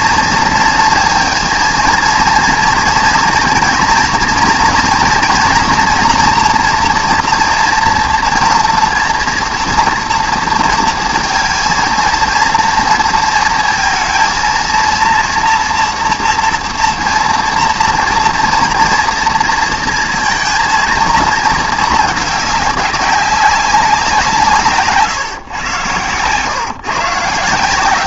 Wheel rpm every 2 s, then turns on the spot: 230, 230, 230, 240, 230, 230, 230, 230, 230, 230, 230, 200, 160, 130.
none